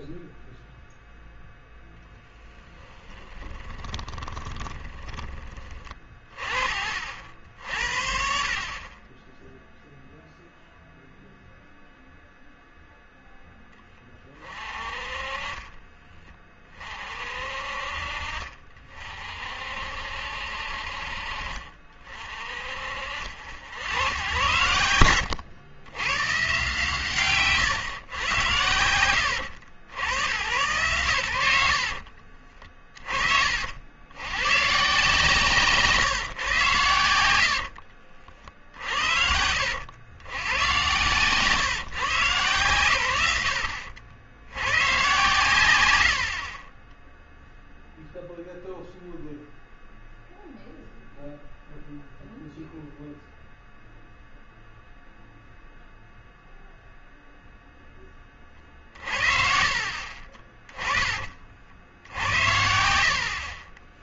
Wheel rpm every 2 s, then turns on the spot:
0, 10, 20, 40, 40, 0, 0, 30, 40, 40, 50, 50, 90, 130, 90, 110, 30, 130, 110, 60, 120, 120, 110, 20, 0, 0, 0, 0, 0, 50, 30, 70.
2-6 38-40 46-48 58-60